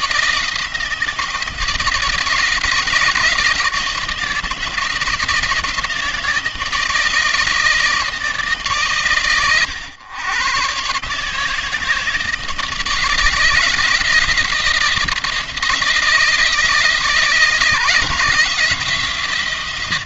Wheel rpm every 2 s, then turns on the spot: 160, 160, 160, 160, 140, 140, 160, 160, 160, 150.
none